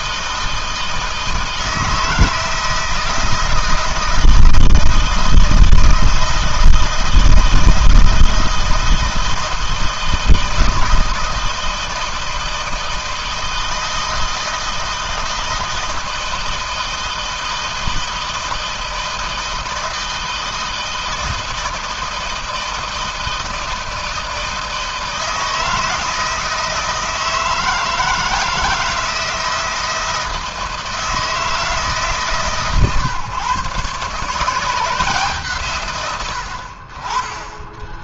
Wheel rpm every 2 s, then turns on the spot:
160, 160, 160, 160, 160, 160, 160, 160, 160, 160, 160, 160, 160, 160, 160, 160, 130, 160, 30.
none